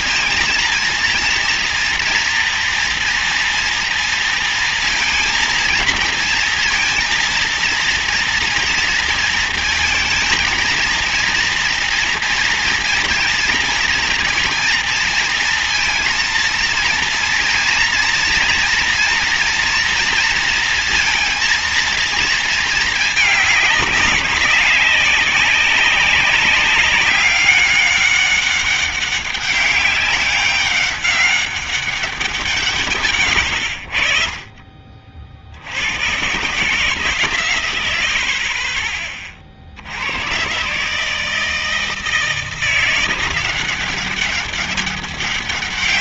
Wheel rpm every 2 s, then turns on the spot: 230, 230, 230, 230, 230, 230, 230, 230, 230, 240, 230, 230, 200, 200, 200, 190, 180, 40, 130, 50, 110, 160, 190.
none